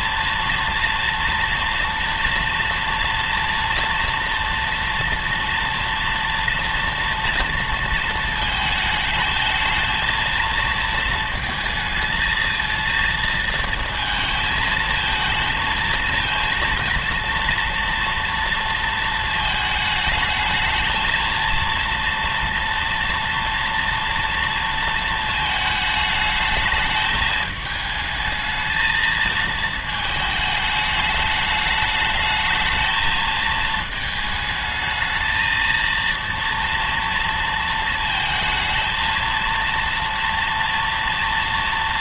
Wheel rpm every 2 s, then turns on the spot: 230, 230, 230, 230, 220, 230, 230, 220, 230, 230, 220, 230, 230, 210, 220, 210, 220, 220, 230, 230, 230.
none